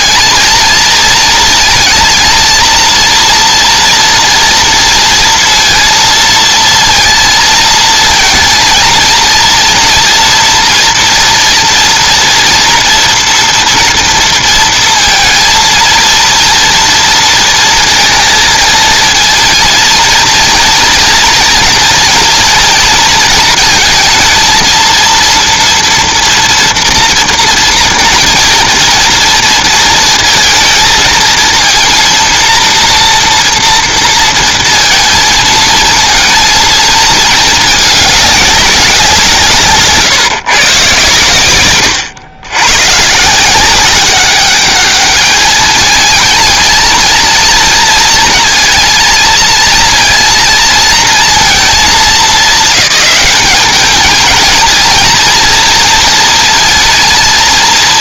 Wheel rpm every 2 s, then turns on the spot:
230, 230, 230, 230, 230, 230, 240, 230, 230, 230, 230, 230, 230, 230, 230, 230, 240, 230, 220, 190, 120, 120, 210, 230, 230, 230, 210, 220, 230.
none